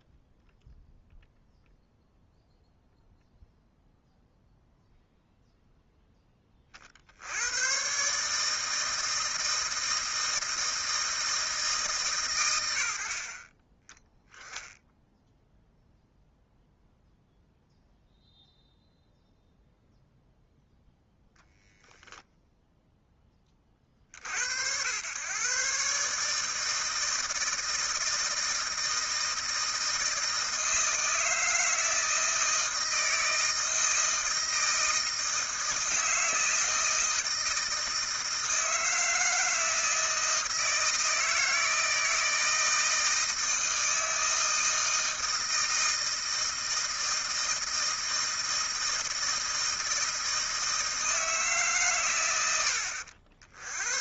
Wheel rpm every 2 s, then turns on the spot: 0, 0, 0, 30, 160, 160, 100, 0, 0, 0, 0, 0, 70, 150, 160, 160, 160, 160, 160, 160, 160, 160, 160, 160, 160, 160, 90.
none